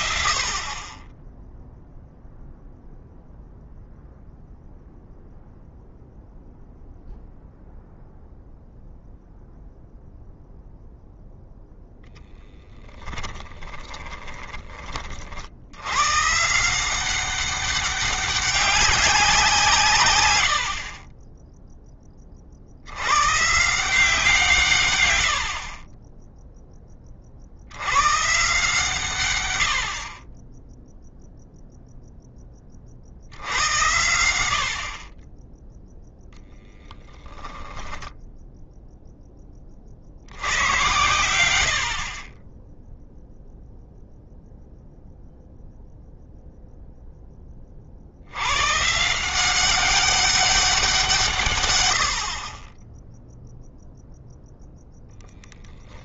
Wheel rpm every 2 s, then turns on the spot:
40, 0, 0, 0, 0, 0, 10, 20, 150, 200, 90, 50, 160, 10, 150, 20, 20, 60, 0, 0, 90, 20, 0, 0, 100, 190, 40, 0.
none